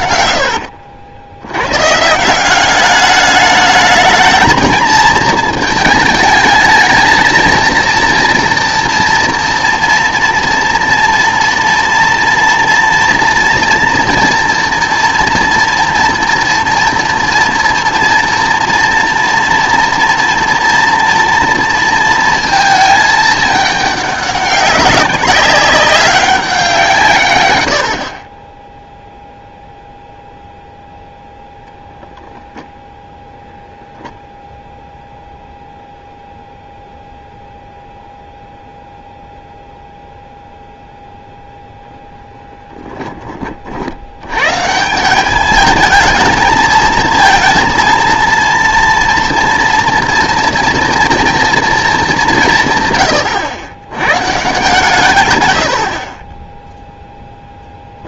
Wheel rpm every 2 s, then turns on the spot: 80, 190, 220, 220, 230, 230, 240, 240, 240, 230, 240, 220, 200, 180, 10, 0, 10, 0, 0, 0, 0, 10, 150, 220, 230, 230, 130, 140, 0.
0-2 32-34 42-44